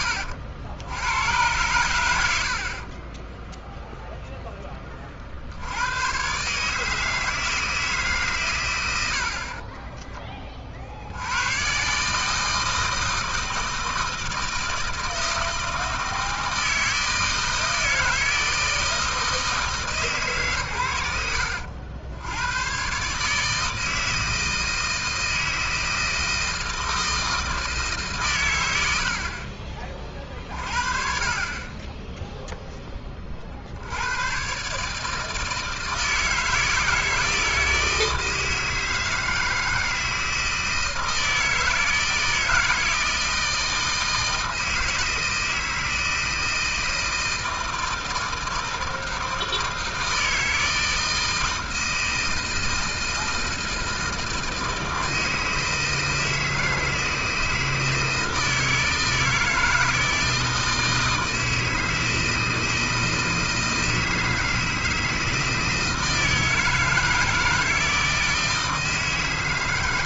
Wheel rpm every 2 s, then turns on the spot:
80, 70, 10, 150, 120, 40, 160, 160, 160, 160, 130, 100, 160, 160, 110, 50, 0, 130, 160, 160, 160, 160, 160, 160, 160, 160, 160, 160, 160, 160, 160, 160, 160, 160, 160.
none